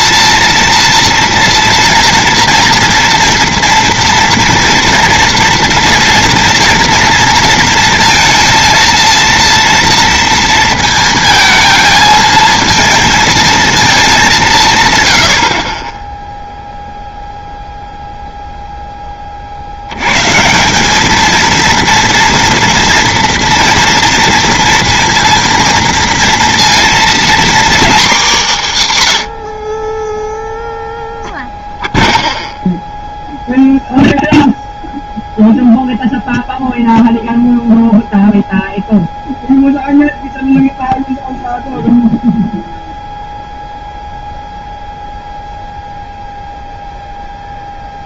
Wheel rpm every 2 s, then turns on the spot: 230, 230, 240, 230, 230, 230, 220, 170, 0, 0, 170, 230, 230, 230, 190, 0, 0, 0, 0, 0, 0, 0, 0, 0.
none